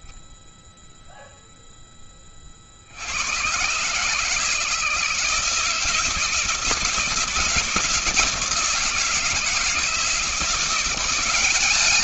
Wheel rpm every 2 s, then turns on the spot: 0, 30, 150, 160, 160, 170.
none